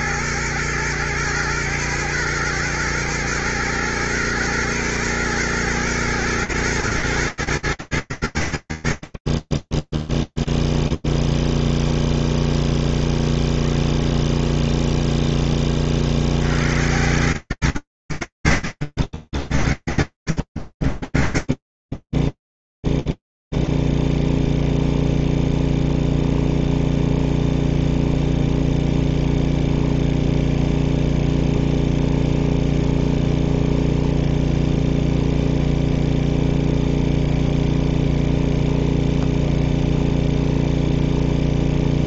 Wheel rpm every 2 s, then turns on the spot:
110, 110, 120, 120, 80, 0, 0, 0, 20, 80, 80, 10, 0, 0, 0, 0, 0, 0, 0, 0, 0.
none